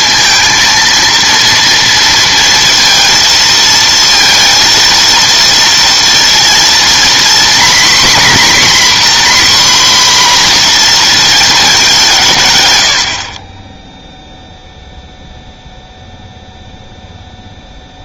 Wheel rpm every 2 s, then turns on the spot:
230, 230, 230, 230, 260, 240, 100, 0, 0.
none